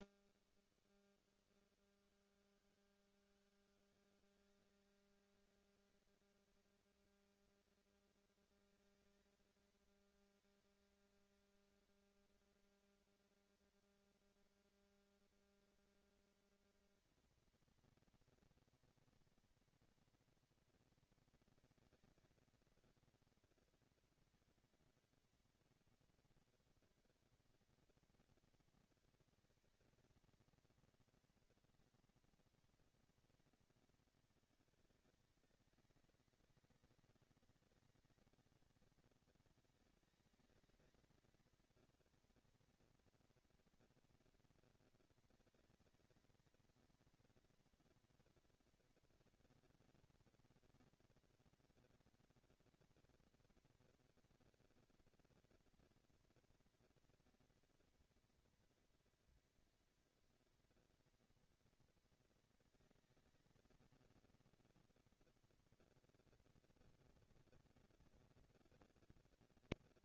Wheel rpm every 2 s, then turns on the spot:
20, 150, 190, 220, 220, 220, 230, 230, 230, 230, 230, 230, 230, 230, 230, 230, 240, 210, 190, 210, 210, 230, 230, 230, 240, 230, 230, 230, 230, 230, 230, 220, 230, 230, 230.
none